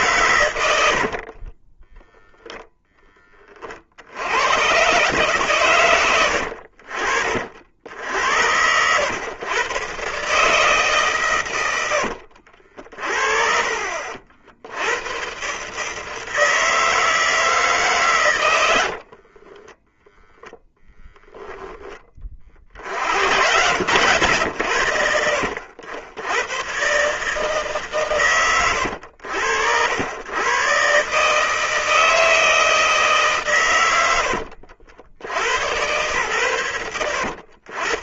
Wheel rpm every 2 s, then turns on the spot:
70, 10, 130, 50, 100, 150, 50, 90, 160, 80, 0, 60, 80, 120, 90, 130, 160, 70, 100.
0-2 18-20